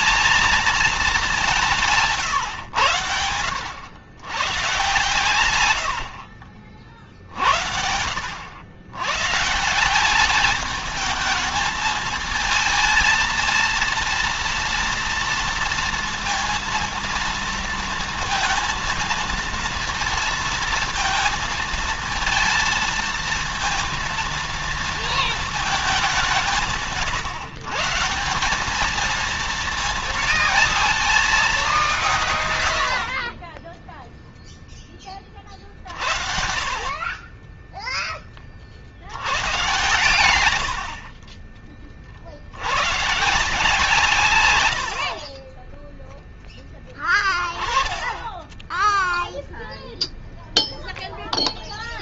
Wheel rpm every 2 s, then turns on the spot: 220, 120, 120, 50, 90, 220, 220, 230, 230, 230, 230, 230, 230, 150, 210, 220, 80, 20, 50, 60, 60, 110, 70, 10, 0, 0.
none